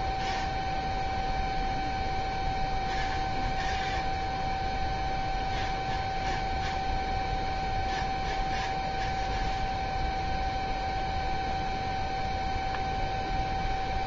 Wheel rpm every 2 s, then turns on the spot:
0, 0, 0, 0, 0, 0, 0.
none